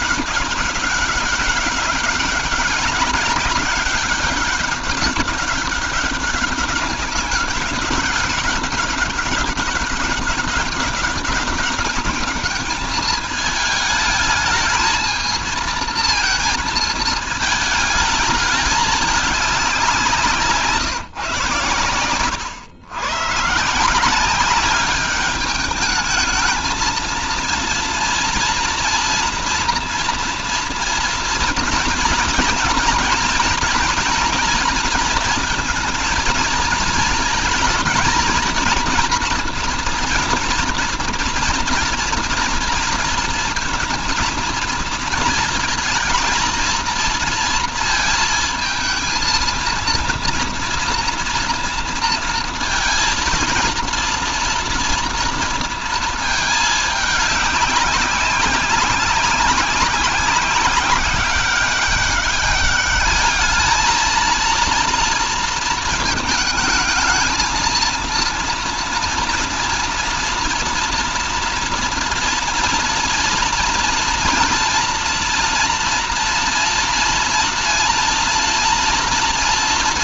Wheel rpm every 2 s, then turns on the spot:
200, 200, 200, 200, 200, 200, 210, 220, 220, 210, 150, 110, 200, 220, 230, 230, 230, 240, 230, 230, 230, 230, 220, 230, 220, 230, 230, 240, 220, 190, 190, 200, 230, 220, 230, 240, 240, 230, 230, 240.
none